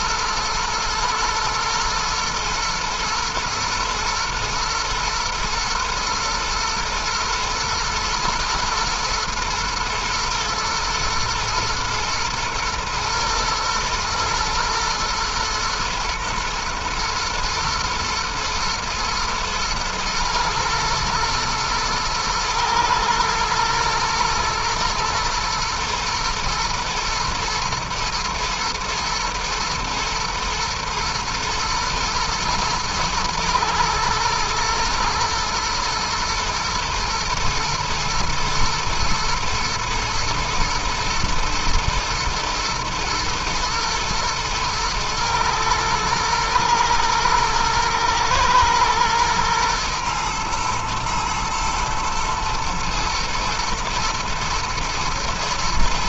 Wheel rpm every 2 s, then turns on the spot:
110, 110, 110, 120, 120, 120, 110, 120, 120, 110, 120, 110, 120, 110, 110, 110, 110, 110, 120, 120, 120, 110, 110, 110, 110, 110, 120, 110.
none